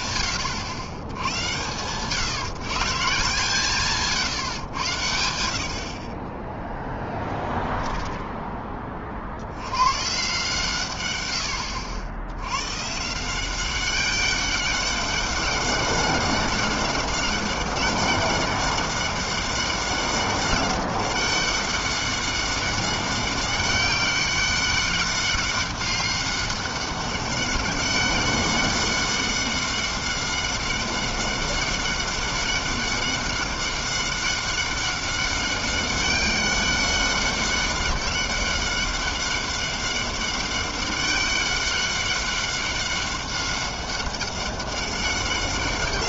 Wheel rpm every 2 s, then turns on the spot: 90, 160, 80, 10, 50, 110, 170, 200, 200, 200, 200, 190, 200, 190, 190, 190, 200, 200, 200, 200, 200, 200, 190.
6-8